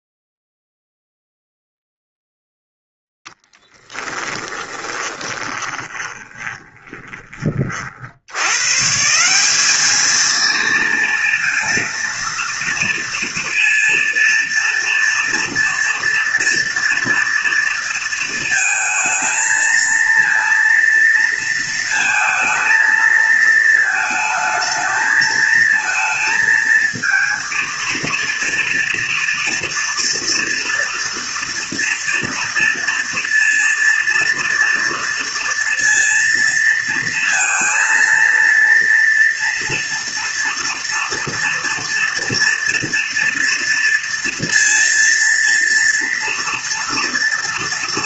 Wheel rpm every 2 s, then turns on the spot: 0, 0, 20, 20, 140, 230, 230, 230, 230, 220, 230, 220, 220, 230, 230, 230, 230, 230, 230, 230, 230, 230, 230, 230.
4-8